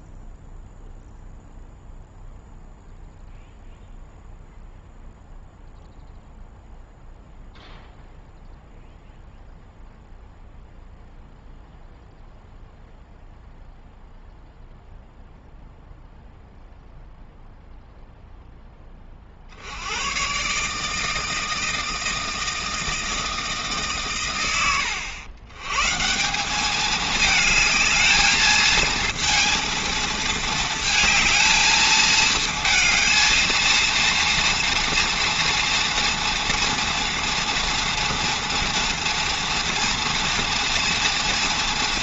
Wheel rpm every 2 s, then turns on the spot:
0, 0, 0, 0, 0, 0, 0, 0, 0, 10, 140, 160, 100, 210, 220, 230, 220, 230, 230, 230, 230.
none